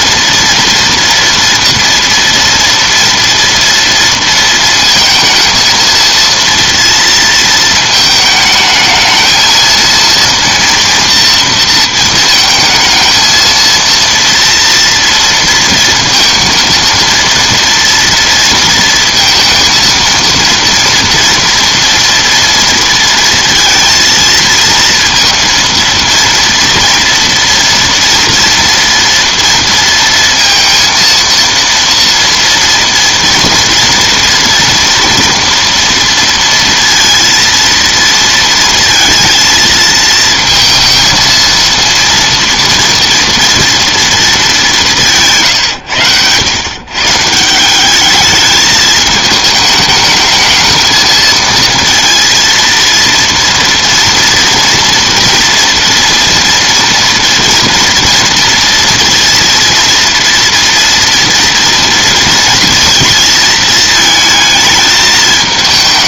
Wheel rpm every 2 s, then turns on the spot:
230, 230, 230, 230, 220, 230, 220, 230, 230, 230, 230, 230, 230, 230, 230, 230, 230, 230, 230, 230, 230, 230, 200, 110, 210, 220, 230, 230, 230, 230, 230, 230, 220.
none